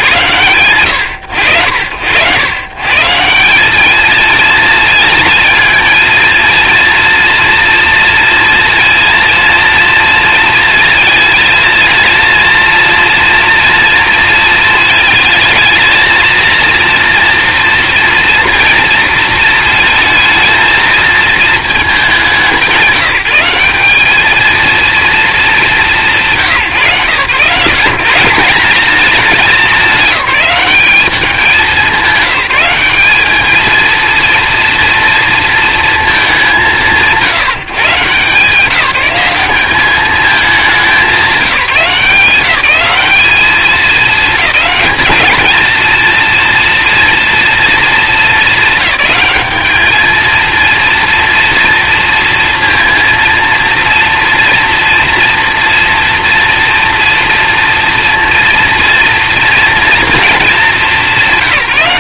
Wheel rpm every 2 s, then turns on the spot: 80, 200, 230, 230, 230, 230, 230, 220, 230, 220, 220, 190, 230, 140, 210, 200, 220, 230, 140, 200, 190, 210, 220, 230, 200, 230, 230, 230, 240, 230, 180.
none